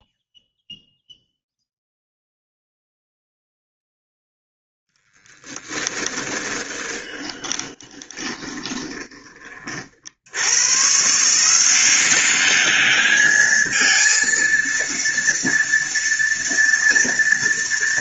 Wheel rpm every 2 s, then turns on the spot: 0, 0, 0, 20, 20, 90, 200, 230, 230.
6-10